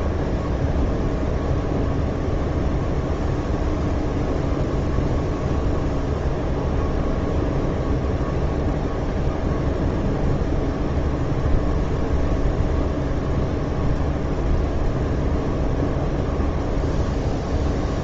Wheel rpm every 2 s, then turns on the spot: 0, 0, 0, 0, 0, 0, 0, 0, 0.
none